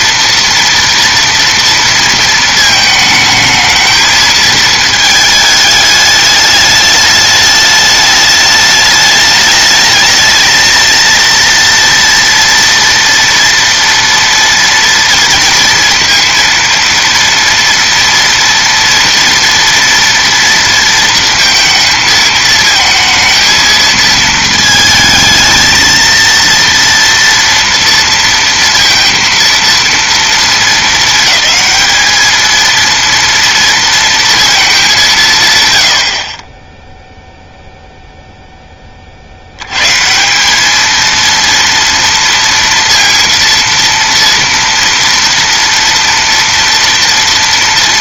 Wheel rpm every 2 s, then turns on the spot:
230, 220, 220, 210, 210, 220, 230, 230, 230, 230, 230, 220, 220, 230, 230, 230, 220, 230, 30, 10, 200, 230, 230, 230.
none